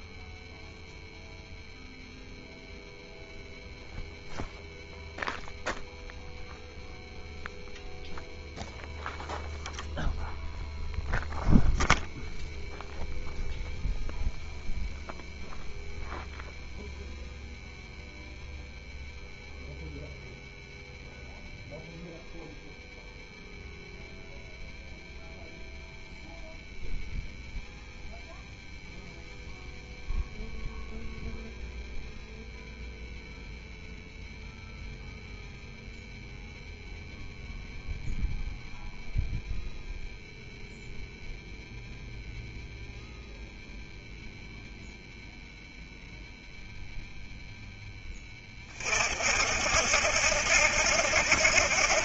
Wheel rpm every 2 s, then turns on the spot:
0, 0, 0, 0, 0, 0, 0, 0, 0, 0, 0, 0, 0, 0, 0, 0, 0, 0, 0, 0, 0, 0, 0, 0, 30, 70.
none